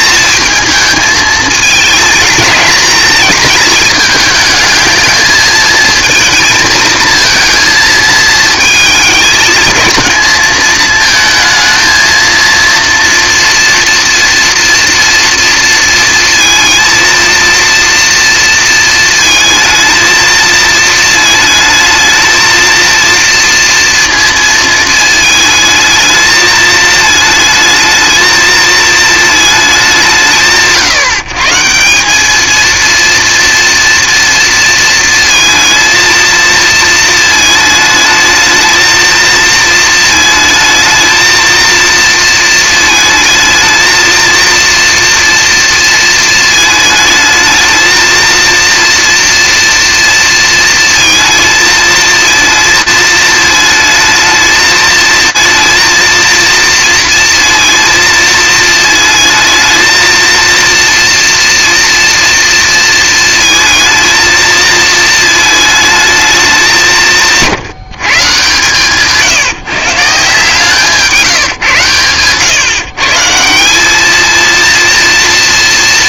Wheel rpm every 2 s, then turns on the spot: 230, 210, 220, 230, 220, 220, 230, 230, 230, 230, 220, 230, 230, 220, 230, 160, 220, 230, 230, 220, 230, 230, 230, 220, 230, 230, 220, 220, 230, 220, 230, 230, 220, 200, 140, 160, 120, 230.
none